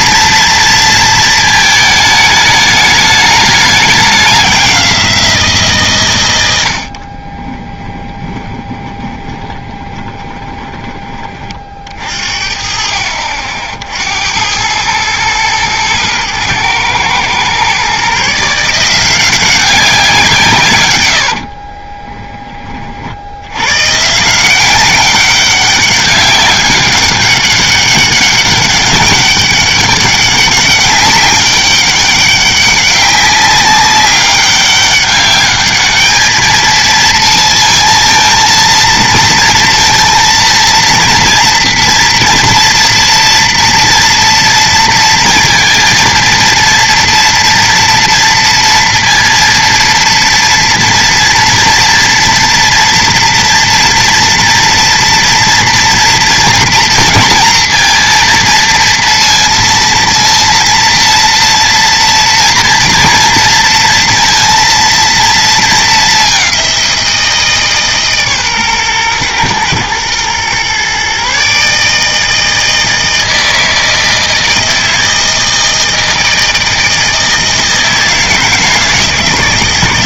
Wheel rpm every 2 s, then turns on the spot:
230, 210, 190, 80, 20, 20, 50, 100, 110, 170, 130, 30, 190, 200, 200, 200, 200, 200, 220, 230, 230, 230, 230, 230, 230, 230, 240, 240, 230, 230, 230, 230, 230, 190, 130, 120, 160, 160, 160, 160.
8-10